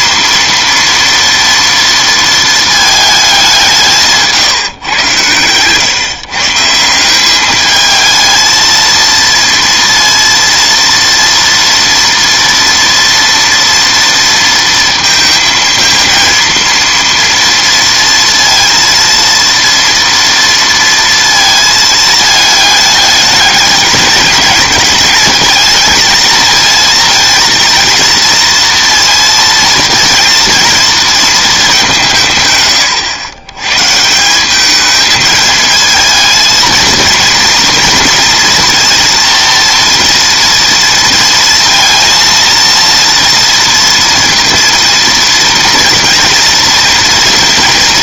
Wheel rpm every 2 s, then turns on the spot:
230, 220, 140, 150, 220, 230, 230, 230, 230, 230, 230, 210, 210, 220, 230, 230, 130, 190, 220, 230, 230, 230, 230, 230.
none